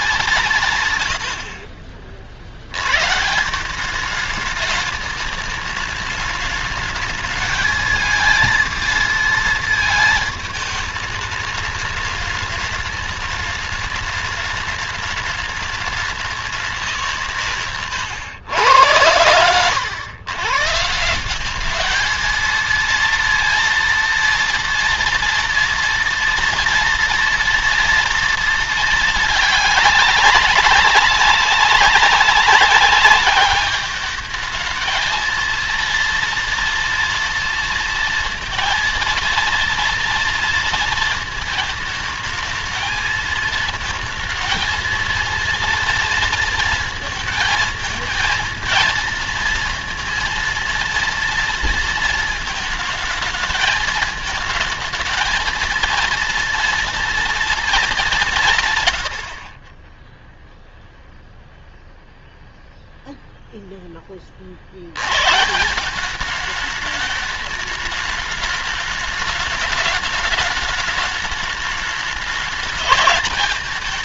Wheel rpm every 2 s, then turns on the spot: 160, 70, 210, 210, 220, 220, 210, 210, 190, 100, 130, 220, 230, 240, 220, 190, 200, 220, 240, 230, 230, 220, 220, 230, 230, 230, 220, 220, 230, 130, 0, 0, 60, 210, 210, 210, 210.
none